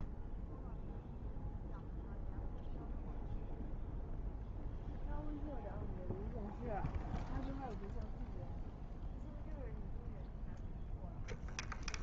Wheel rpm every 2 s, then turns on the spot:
0, 0, 0, 0, 0, 0.
none